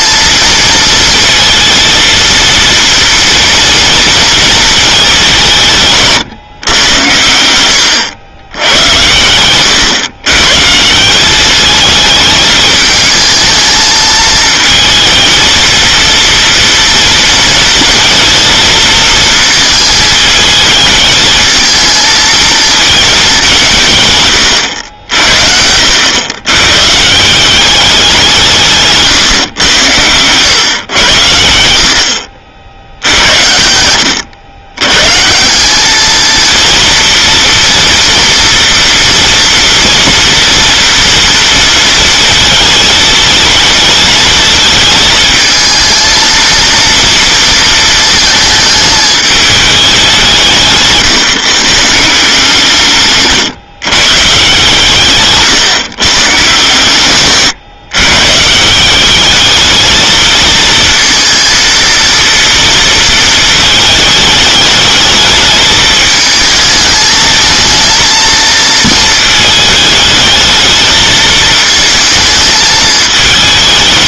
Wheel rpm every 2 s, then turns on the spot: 230, 230, 220, 110, 110, 150, 210, 220, 230, 220, 220, 220, 100, 130, 160, 110, 70, 130, 230, 230, 230, 220, 220, 230, 220, 150, 150, 130, 130, 170, 220, 230, 210, 220, 220, 220, 210.
none